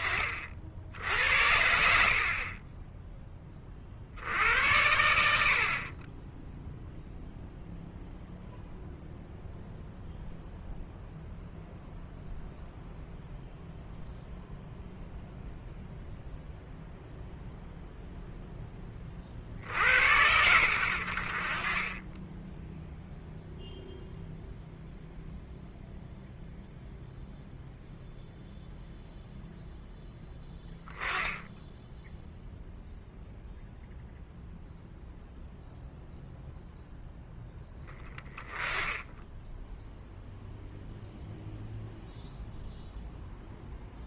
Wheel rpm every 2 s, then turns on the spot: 60, 20, 90, 0, 0, 0, 0, 0, 0, 20, 80, 0, 0, 0, 0, 10, 0, 0, 0, 10, 0, 0.
none